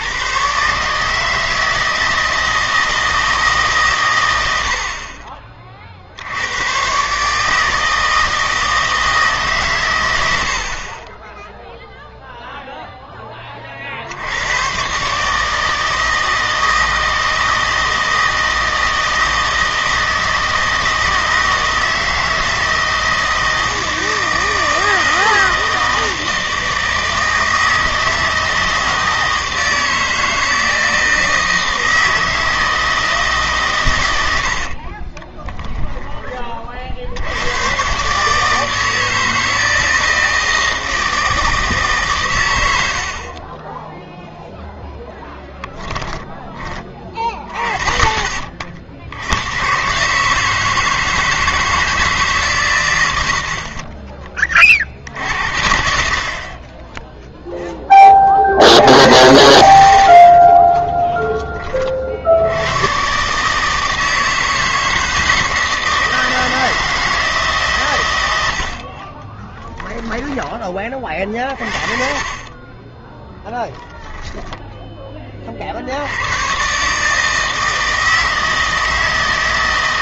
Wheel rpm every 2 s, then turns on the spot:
140, 160, 60, 130, 160, 50, 0, 120, 160, 160, 160, 160, 160, 160, 160, 160, 160, 50, 40, 160, 160, 90, 0, 10, 50, 160, 110, 40, 20, 80, 20, 110, 160, 160, 60, 20, 20, 10, 140, 160.
34-36 60-62 68-70